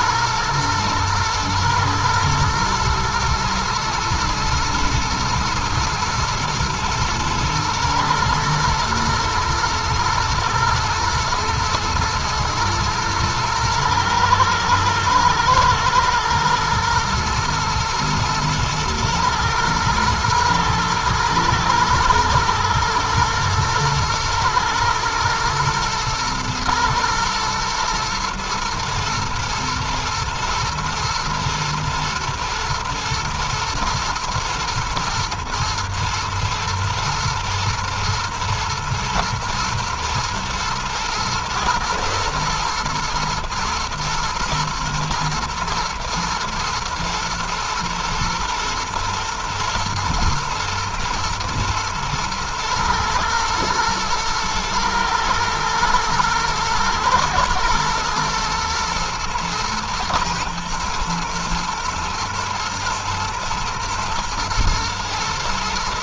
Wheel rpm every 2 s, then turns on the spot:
110, 110, 110, 120, 120, 110, 120, 110, 110, 110, 110, 110, 120, 110, 120, 110, 110, 110, 110, 120, 120, 110, 110, 120, 120, 120, 110, 110, 110, 110, 110, 120, 110.
none